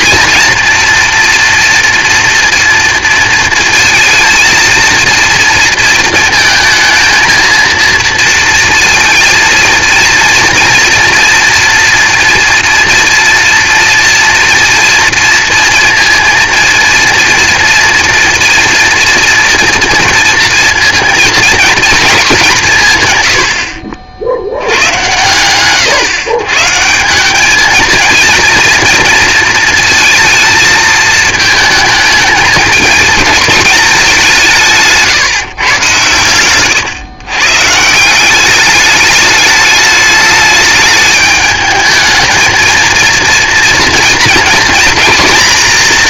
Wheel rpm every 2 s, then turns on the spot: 230, 230, 230, 230, 230, 230, 230, 230, 230, 230, 230, 200, 90, 140, 230, 220, 210, 170, 120, 200, 210, 230, 240.
none